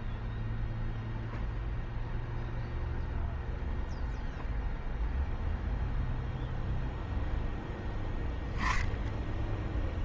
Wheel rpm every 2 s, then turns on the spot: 0, 0, 0, 0, 0.
none